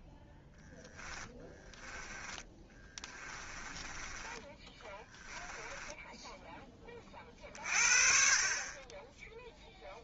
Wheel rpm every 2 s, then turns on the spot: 20, 20, 10, 0, 20.
0-6